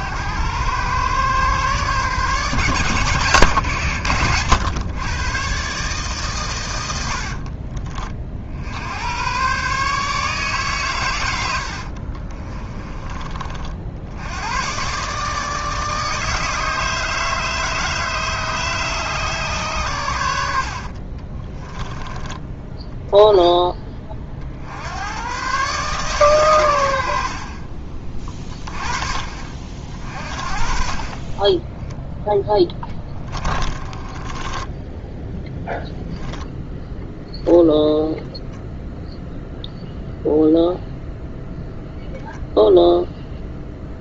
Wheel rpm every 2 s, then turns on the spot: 120, 140, 120, 100, 80, 130, 30, 120, 160, 150, 50, 10, 80, 80, 30, 40, 10, 10, 0, 0, 0, 0.
12-14 20-22 32-36